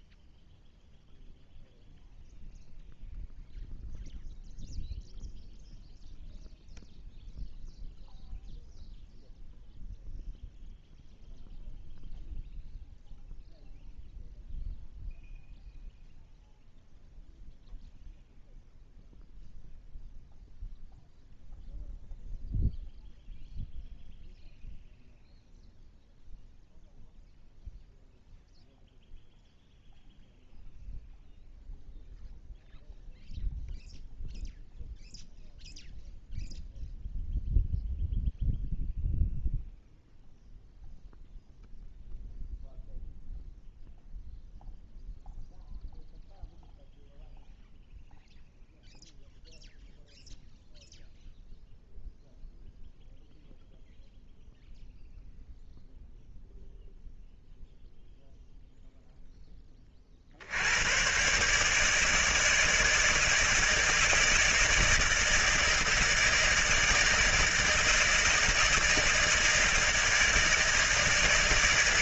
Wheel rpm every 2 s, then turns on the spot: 0, 0, 0, 0, 0, 0, 0, 0, 0, 0, 0, 0, 0, 0, 0, 0, 0, 0, 0, 0, 0, 0, 0, 0, 0, 0, 0, 0, 0, 0, 70, 160, 160, 160, 160, 160.
none